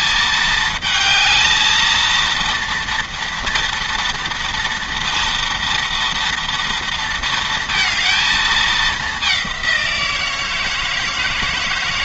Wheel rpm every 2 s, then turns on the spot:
220, 230, 230, 230, 210, 150.
none